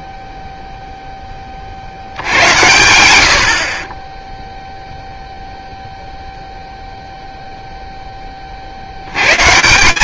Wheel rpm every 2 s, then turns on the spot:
0, 90, 0, 0, 130.
none